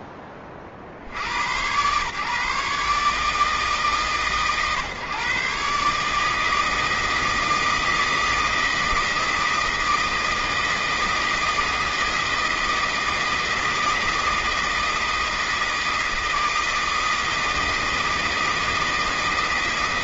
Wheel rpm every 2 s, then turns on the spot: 70, 150, 140, 160, 160, 160, 160, 160, 160, 160.
none